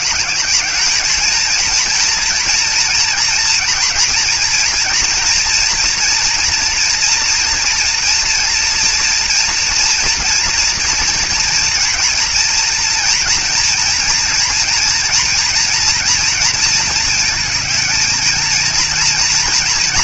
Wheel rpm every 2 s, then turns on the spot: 210, 230, 230, 230, 230, 240, 230, 230, 220, 220.
none